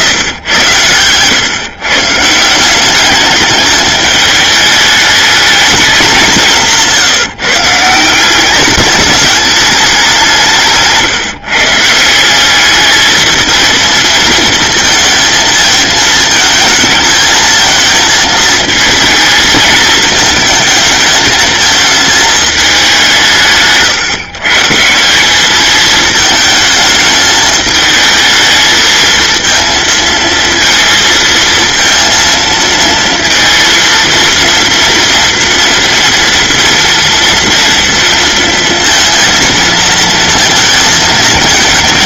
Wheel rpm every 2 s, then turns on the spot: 120, 200, 220, 160, 210, 150, 220, 230, 220, 220, 220, 180, 180, 220, 230, 230, 230, 230, 230, 230, 220.
none